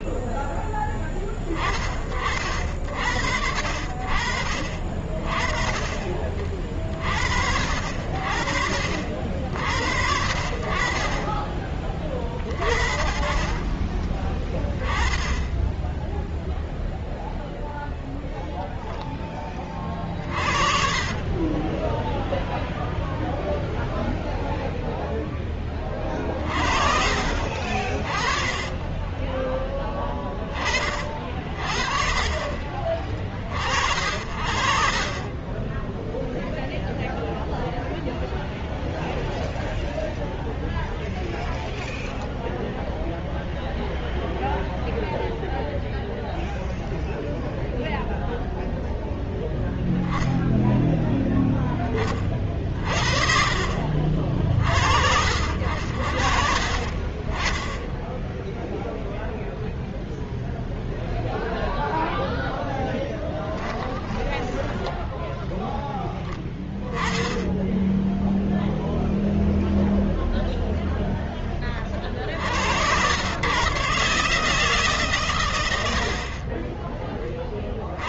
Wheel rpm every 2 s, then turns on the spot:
10, 70, 40, 50, 50, 40, 40, 20, 0, 0, 40, 0, 0, 40, 20, 40, 40, 40, 0, 0, 0, 0, 0, 0, 0, 10, 50, 50, 40, 0, 0, 10, 10, 20, 0, 10, 100, 150, 20.
20-22 64-66